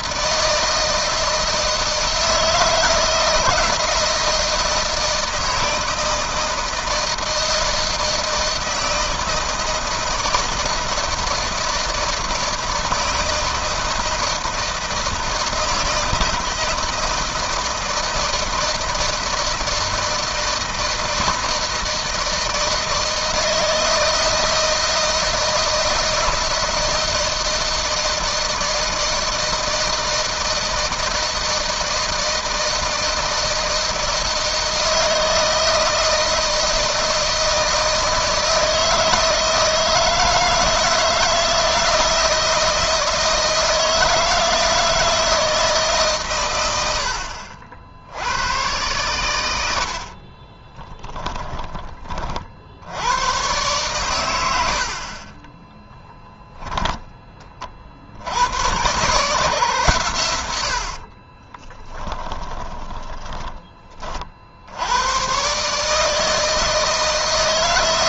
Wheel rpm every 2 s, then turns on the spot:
160, 160, 160, 160, 160, 160, 160, 160, 160, 160, 160, 160, 170, 170, 160, 160, 160, 160, 160, 160, 160, 160, 160, 80, 110, 10, 90, 50, 20, 110, 50, 20, 90, 160.
50-52 54-56 60-64